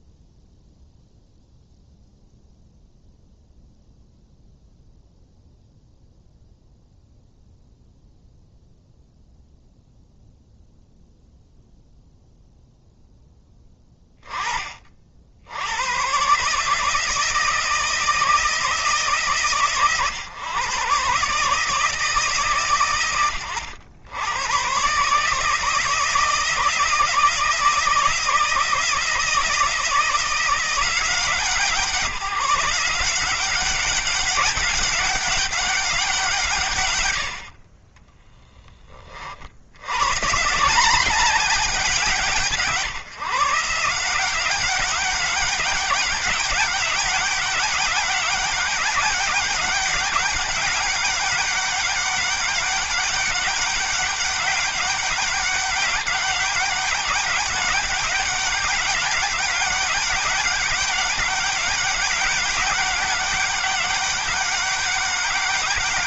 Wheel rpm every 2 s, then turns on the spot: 0, 0, 0, 0, 0, 0, 0, 40, 150, 150, 130, 110, 130, 160, 160, 170, 180, 200, 120, 20, 170, 150, 200, 200, 200, 200, 200, 200, 200, 200, 190, 200, 190.
none